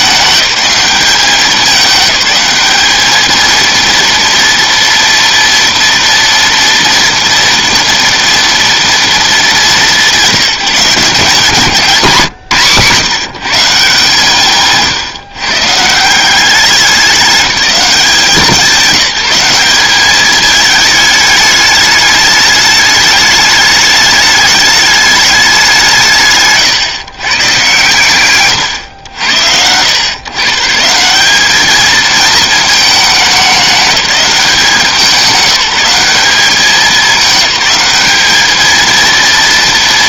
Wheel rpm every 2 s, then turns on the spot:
190, 200, 230, 230, 230, 170, 160, 150, 190, 190, 210, 210, 210, 150, 100, 170, 210, 180, 210, 230.
none